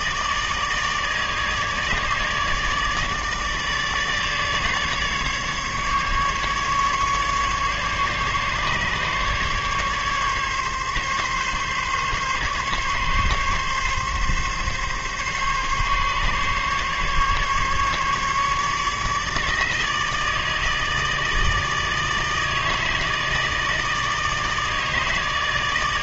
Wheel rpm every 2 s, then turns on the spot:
150, 150, 150, 150, 150, 140, 140, 140, 140, 150, 160, 160, 160.
none